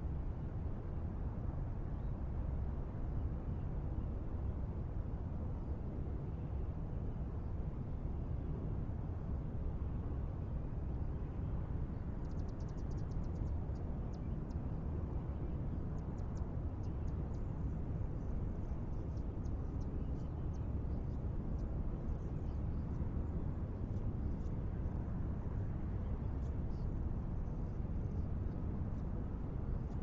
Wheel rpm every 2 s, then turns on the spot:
0, 0, 0, 0, 0, 0, 0, 0, 0, 0, 0, 0, 0, 0, 0.
none